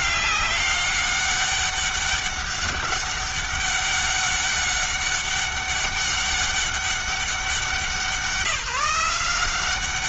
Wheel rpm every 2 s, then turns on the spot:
200, 200, 200, 200, 170.
none